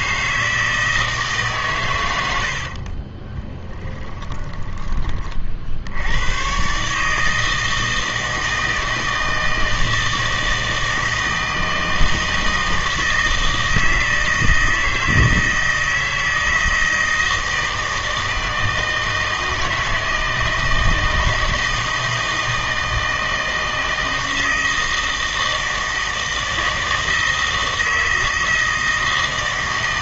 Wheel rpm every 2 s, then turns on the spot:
160, 60, 20, 140, 160, 160, 160, 160, 160, 160, 160, 160, 160, 160, 160.
2-4